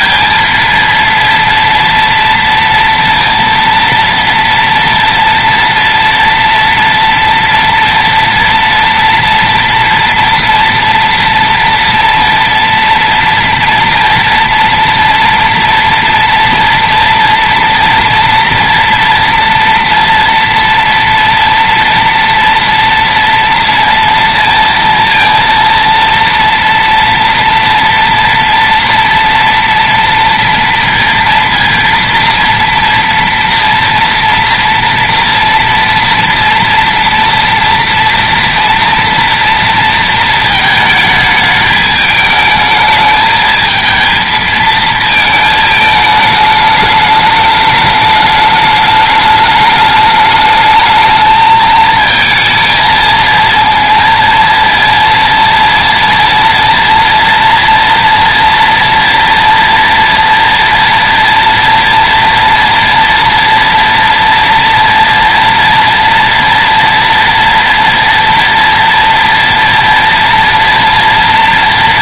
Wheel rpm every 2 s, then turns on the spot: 230, 230, 230, 230, 230, 230, 240, 230, 230, 230, 230, 230, 230, 230, 230, 230, 230, 230, 230, 230, 230, 220, 220, 210, 210, 210, 220, 230, 230, 240, 230, 230, 230, 230, 230, 230.
none